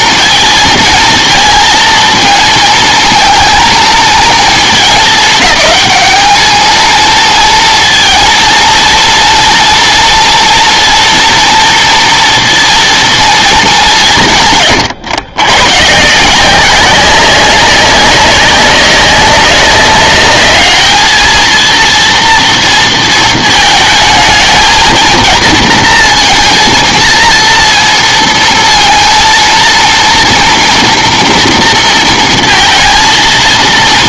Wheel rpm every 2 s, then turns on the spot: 230, 220, 220, 220, 230, 230, 230, 140, 190, 200, 210, 230, 220, 230, 230, 230, 230.
none